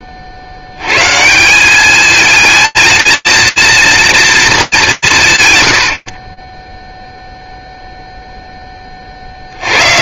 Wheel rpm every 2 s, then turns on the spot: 70, 230, 190, 10, 10.
none